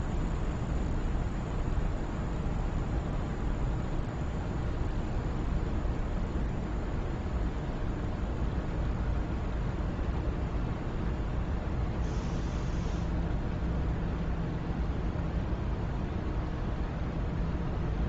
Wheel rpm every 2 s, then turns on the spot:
0, 0, 0, 0, 0, 0, 0, 0, 0.
none